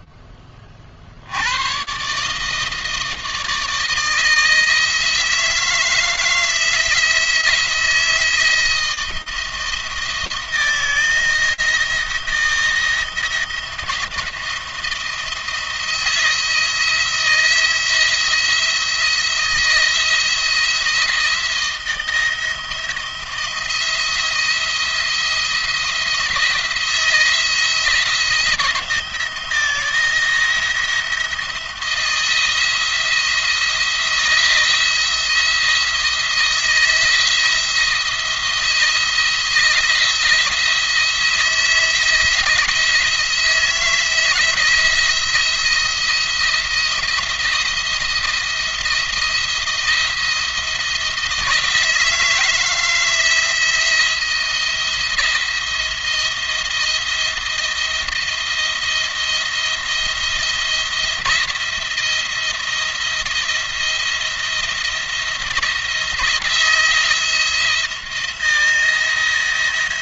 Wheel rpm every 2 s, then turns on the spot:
40, 160, 160, 160, 160, 170, 170, 170, 170, 170, 170, 170, 170, 170, 170, 170, 170, 170, 160, 160, 160, 160, 170, 170, 170, 160, 160, 170, 170, 170, 160, 170, 170, 170, 170.
none